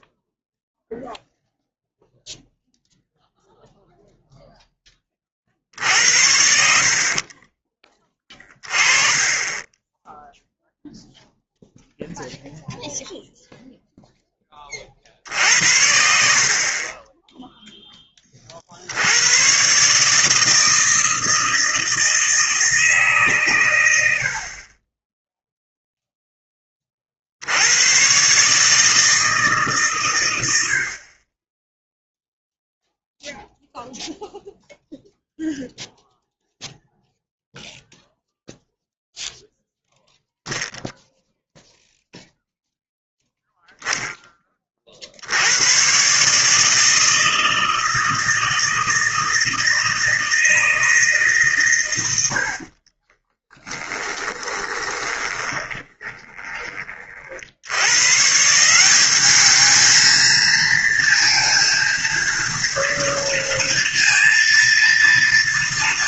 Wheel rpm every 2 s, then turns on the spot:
0, 0, 60, 20, 20, 0, 0, 60, 10, 120, 160, 130, 0, 70, 150, 20, 0, 0, 0, 0, 0, 0, 40, 160, 160, 160, 40, 10, 20, 170, 230, 230, 230.
52-56